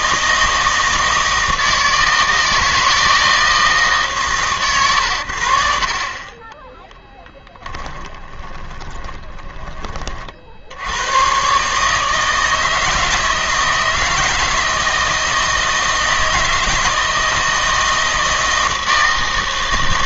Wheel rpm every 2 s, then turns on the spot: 160, 160, 130, 20, 20, 60, 160, 160, 160, 160.
6-10